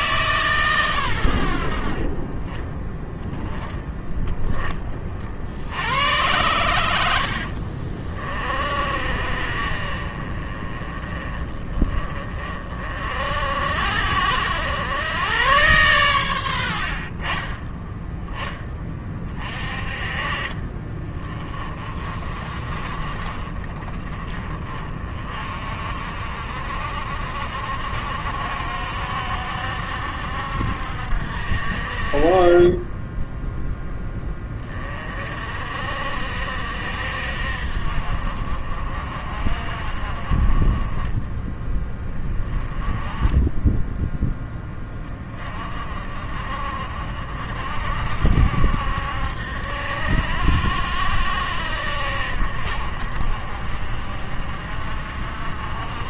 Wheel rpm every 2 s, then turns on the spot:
120, 10, 20, 80, 50, 30, 50, 90, 60, 20, 20, 40, 30, 60, 60, 60, 10, 30, 60, 50, 20, 20, 20, 50, 70, 70, 60, 50.
none